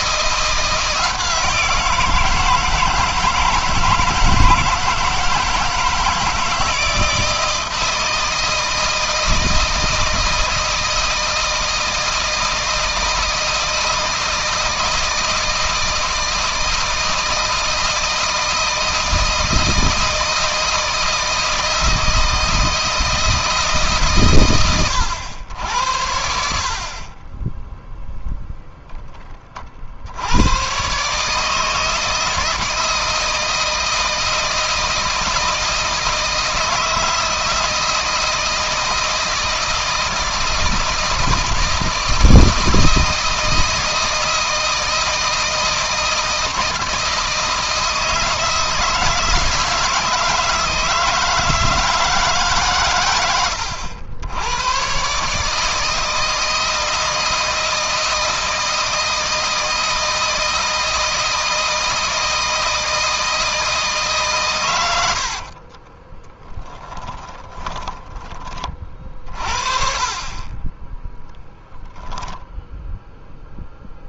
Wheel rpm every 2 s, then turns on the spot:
170, 160, 160, 160, 160, 160, 160, 160, 160, 160, 160, 160, 100, 30, 10, 120, 160, 160, 160, 160, 160, 160, 160, 160, 160, 160, 120, 120, 160, 160, 160, 160, 110, 20, 40, 10, 0.
64-68